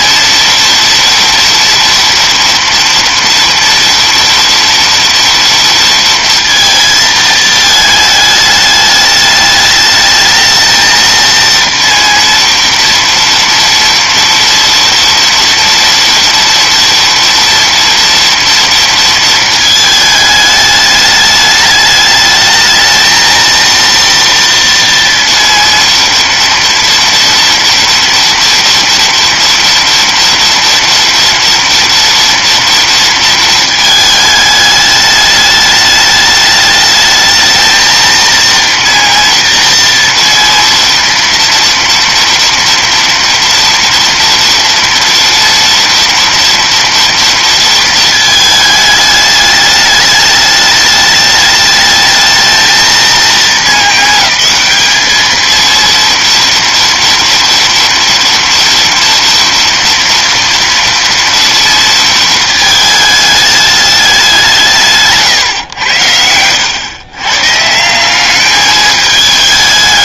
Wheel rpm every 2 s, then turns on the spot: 230, 230, 230, 230, 210, 220, 230, 230, 230, 230, 210, 220, 230, 230, 230, 230, 230, 210, 210, 230, 230, 230, 230, 230, 220, 210, 220, 210, 230, 230, 230, 220, 170, 100, 210.
none